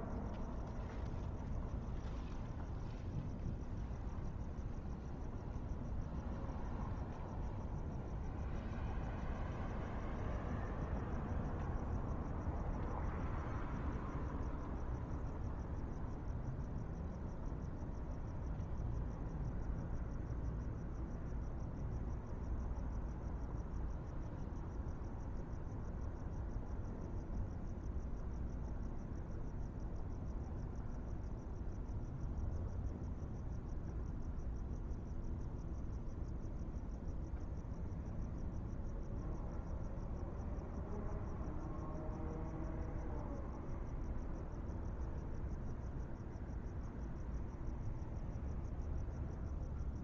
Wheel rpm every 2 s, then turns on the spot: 0, 0, 0, 0, 0, 0, 0, 0, 0, 0, 0, 0, 0, 0, 0, 0, 0, 0, 0, 0, 0, 0, 0, 0, 0.
none